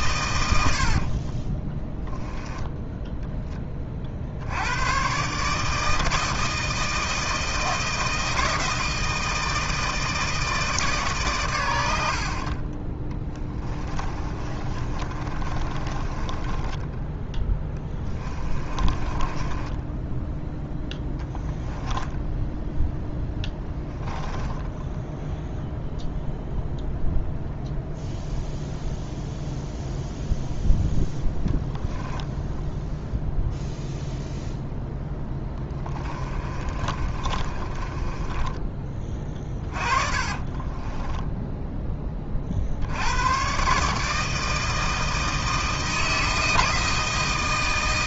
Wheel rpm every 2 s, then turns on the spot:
80, 10, 90, 160, 160, 150, 30, 30, 10, 20, 0, 0, 10, 0, 0, 0, 0, 0, 30, 20, 20, 60, 160, 160.
0-2 14-20 24-26 36-38 40-42